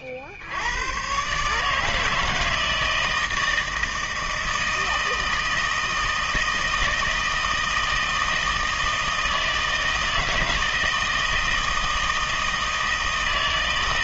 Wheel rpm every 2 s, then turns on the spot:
60, 160, 160, 160, 160, 160, 160.
none